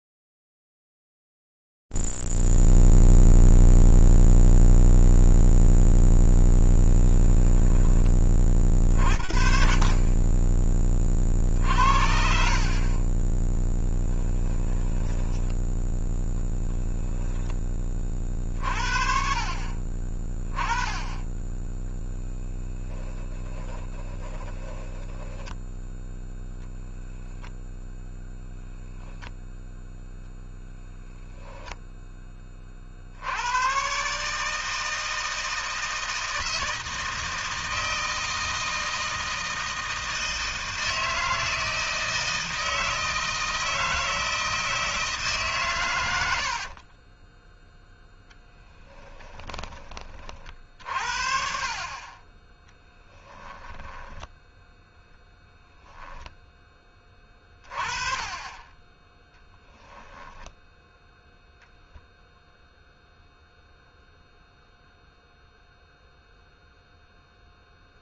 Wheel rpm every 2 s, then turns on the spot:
0, 0, 0, 0, 40, 20, 40, 10, 10, 50, 20, 10, 10, 0, 0, 10, 60, 160, 160, 160, 160, 160, 160, 40, 10, 50, 10, 0, 20, 20, 0, 0, 0, 0.
10-12 14-18 22-26 30-32 46-50 52-54